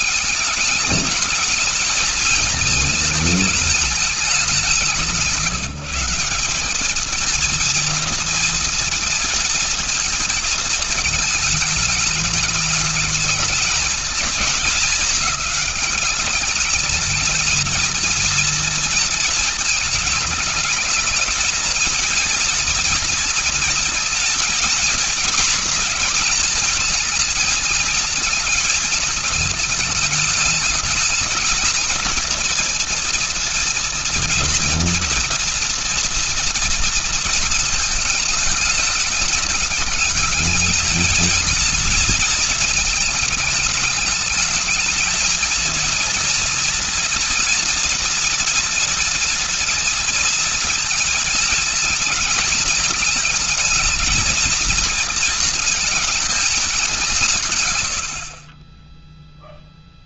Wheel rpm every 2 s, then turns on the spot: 210, 210, 170, 200, 230, 230, 210, 200, 210, 220, 220, 230, 230, 220, 230, 220, 230, 230, 230, 220, 210, 230, 210, 230, 230, 230, 220, 230, 220, 50.
none